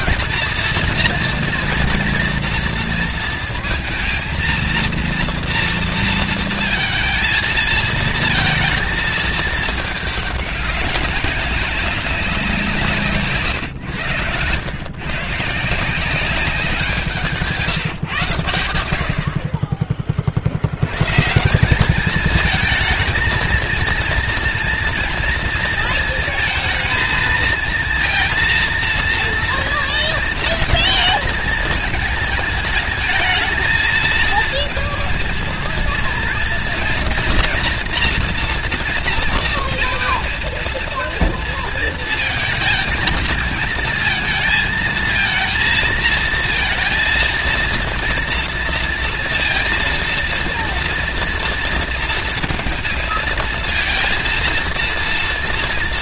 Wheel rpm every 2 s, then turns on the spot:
230, 230, 230, 230, 230, 200, 170, 130, 180, 100, 80, 220, 230, 220, 230, 230, 220, 230, 240, 240, 230, 220, 220, 230, 230, 230, 230, 230.
none